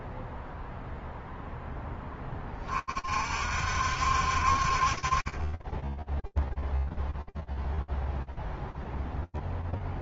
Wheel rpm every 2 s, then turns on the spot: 0, 20, 40, 0, 0.
none